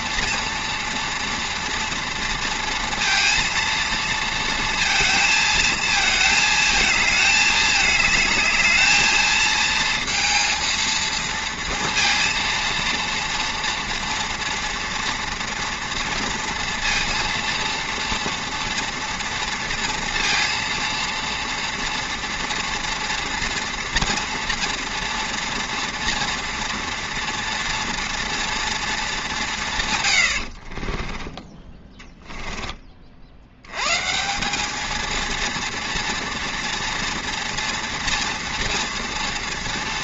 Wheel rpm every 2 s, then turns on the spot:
230, 230, 230, 220, 220, 230, 230, 230, 230, 230, 230, 230, 230, 230, 230, 40, 20, 200, 230, 230.
30-32